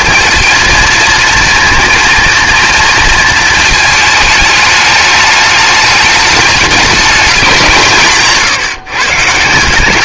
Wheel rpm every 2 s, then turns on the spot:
230, 230, 210, 210, 140.
none